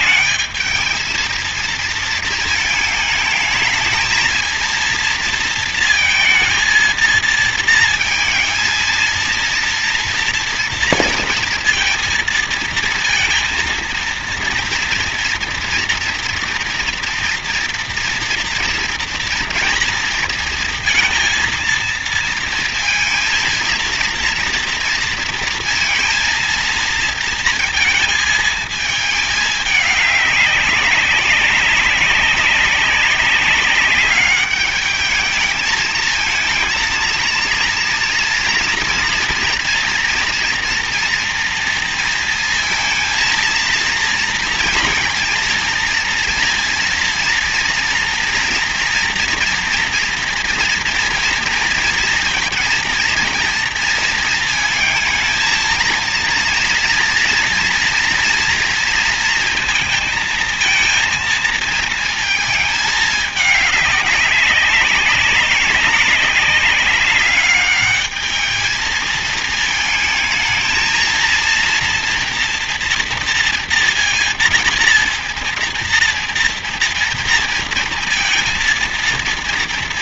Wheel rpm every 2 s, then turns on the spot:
210, 220, 230, 230, 230, 230, 230, 230, 230, 230, 230, 230, 230, 230, 220, 200, 200, 210, 220, 230, 230, 230, 230, 230, 230, 230, 230, 230, 230, 230, 230, 220, 200, 200, 210, 220, 230, 230, 230, 230.
none